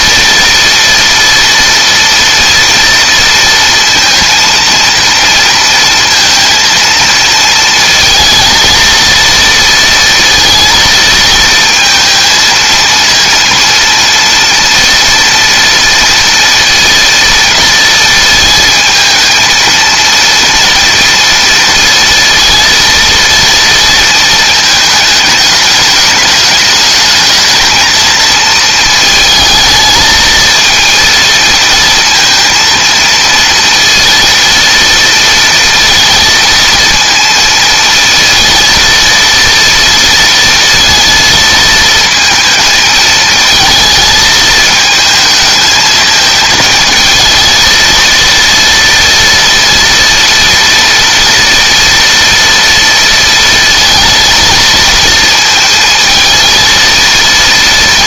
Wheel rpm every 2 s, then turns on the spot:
230, 230, 230, 230, 230, 230, 230, 230, 230, 230, 230, 230, 230, 210, 230, 220, 230, 230, 230, 230, 230, 230, 220, 220, 230, 230, 230, 230, 230.
none